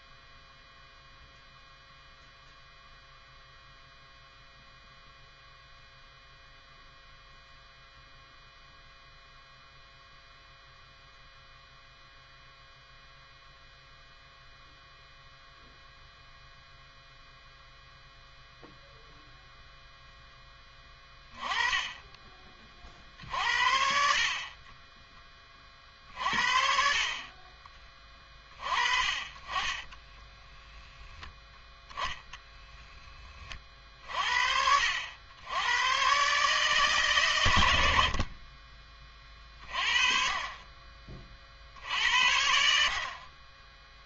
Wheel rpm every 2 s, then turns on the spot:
0, 0, 0, 0, 0, 0, 0, 0, 0, 0, 20, 40, 30, 50, 30, 10, 10, 70, 140, 40, 30, 60.
none